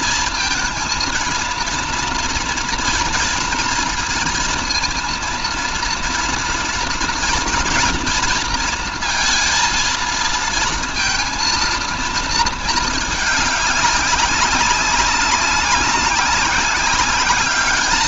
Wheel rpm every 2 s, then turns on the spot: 230, 230, 230, 230, 230, 230, 220, 200, 200.
none